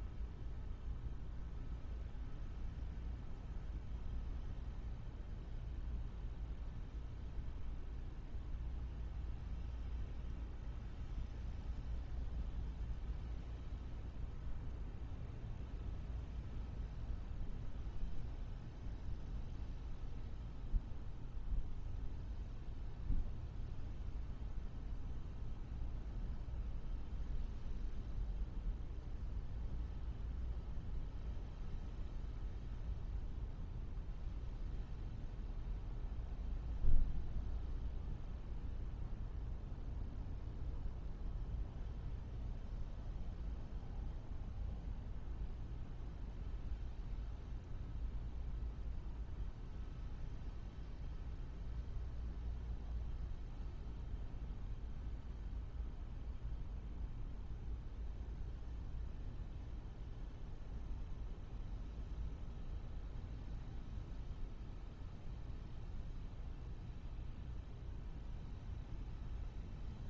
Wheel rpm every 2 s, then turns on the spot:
0, 0, 0, 0, 0, 0, 0, 0, 0, 0, 0, 0, 0, 0, 0, 0, 0, 0, 0, 0, 0, 0, 0, 0, 0, 0, 0, 0, 0, 0, 0, 0, 0, 0, 0.
none